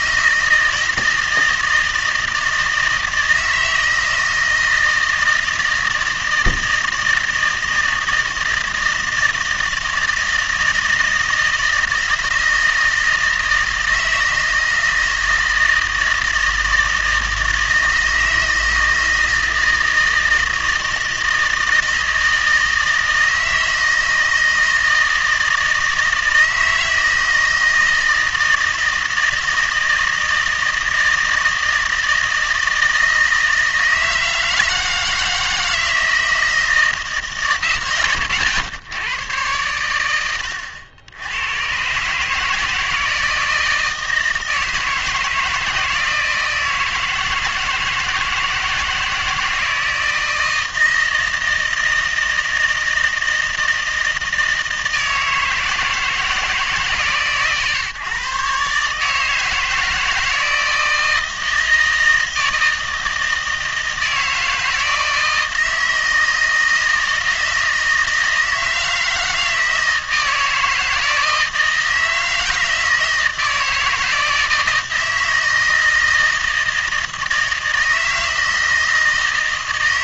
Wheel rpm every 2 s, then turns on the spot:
160, 160, 160, 160, 160, 160, 160, 160, 160, 160, 160, 160, 160, 160, 160, 160, 160, 160, 160, 120, 90, 160, 160, 160, 160, 160, 160, 160, 160, 140, 160, 160, 160, 160, 160, 160, 160, 160, 160, 160.
40-42